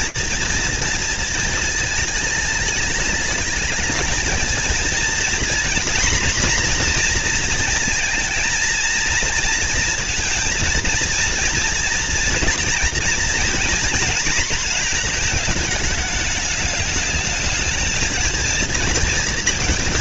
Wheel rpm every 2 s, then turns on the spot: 230, 220, 220, 240, 230, 230, 230, 240, 210, 230.
none